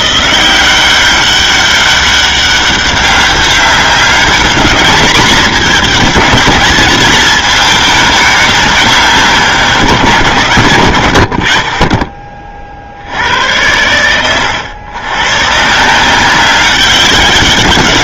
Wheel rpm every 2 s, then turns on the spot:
180, 200, 200, 210, 210, 150, 30, 100, 180.
none